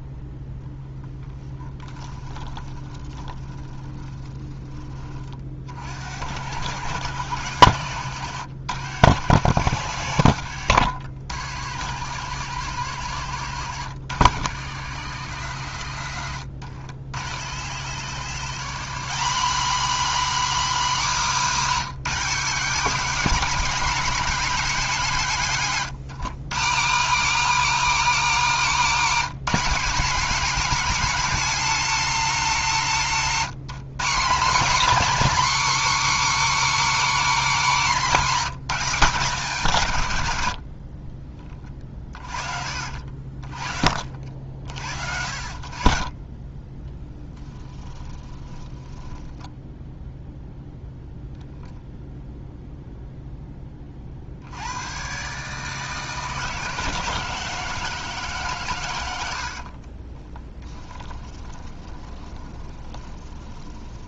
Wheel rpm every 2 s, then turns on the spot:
0, 20, 20, 100, 110, 80, 120, 100, 90, 200, 270, 230, 220, 210, 250, 250, 200, 260, 290, 210, 50, 50, 60, 20, 10, 0, 0, 100, 160, 110, 10, 20.
2-4 48-50 60-64